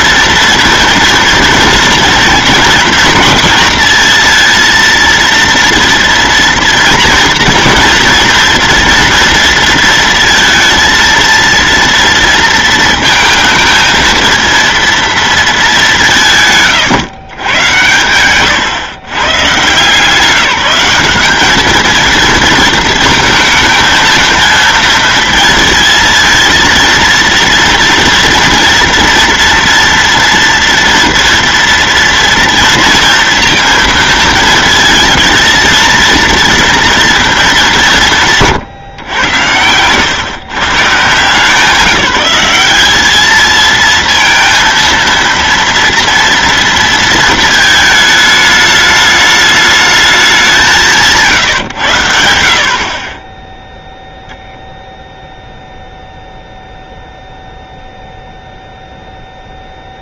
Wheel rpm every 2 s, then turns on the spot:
230, 230, 230, 230, 230, 230, 230, 230, 130, 120, 180, 220, 230, 230, 230, 230, 230, 220, 230, 130, 140, 200, 230, 230, 210, 190, 60, 0, 0, 0.
none